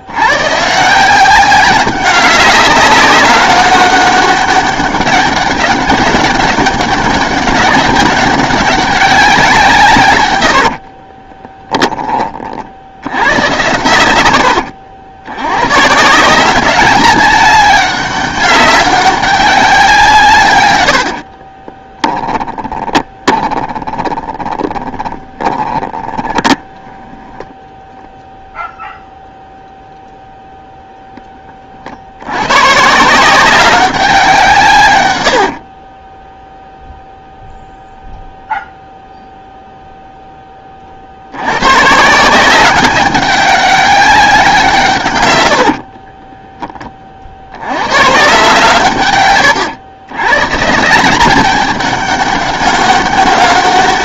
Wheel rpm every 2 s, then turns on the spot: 170, 190, 200, 190, 190, 50, 50, 90, 200, 200, 90, 20, 30, 10, 0, 0, 150, 120, 0, 0, 40, 190, 150, 30, 130, 160, 200.
10-12 20-26 34-36